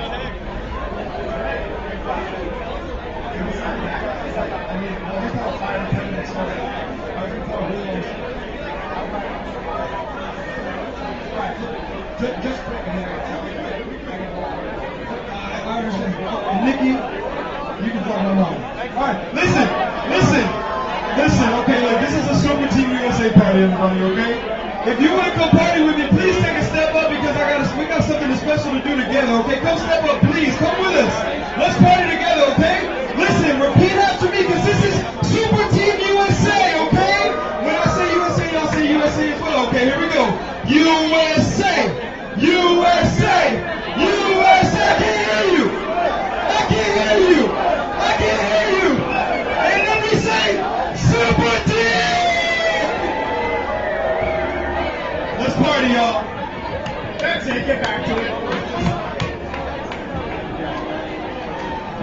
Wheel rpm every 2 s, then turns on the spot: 0, 0, 0, 0, 0, 0, 0, 0, 0, 0, 0, 0, 0, 0, 0, 0, 0, 0, 0, 0, 0, 0, 0, 0, 0, 0, 0, 0, 0, 0, 0.
none